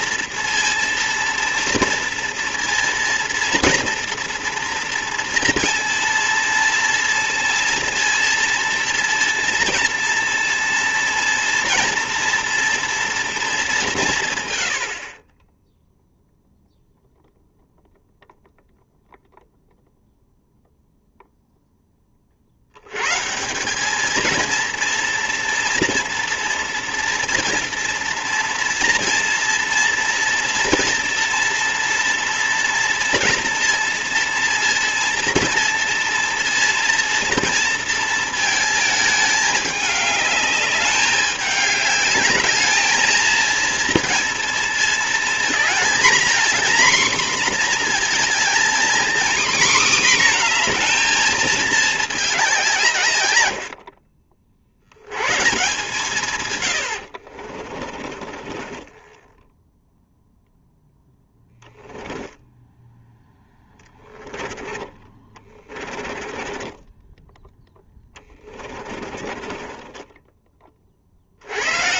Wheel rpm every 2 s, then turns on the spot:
230, 230, 240, 230, 230, 230, 230, 90, 0, 0, 0, 70, 230, 230, 230, 230, 230, 230, 230, 220, 210, 210, 230, 250, 240, 240, 170, 70, 110, 20, 0, 10, 10, 20, 20, 20.
58-60 62-70